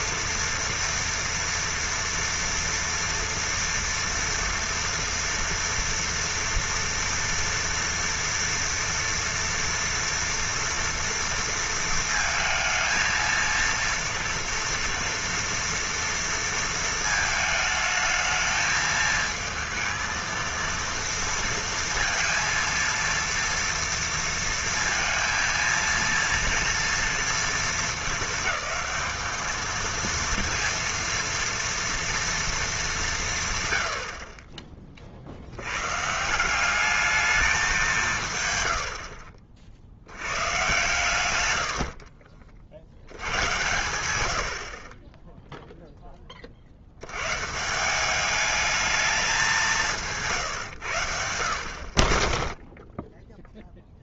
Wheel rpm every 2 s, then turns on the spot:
230, 230, 230, 230, 230, 230, 230, 230, 230, 220, 230, 230, 230, 230, 220, 230, 230, 40, 190, 110, 130, 40, 70, 40, 210, 140, 10.
none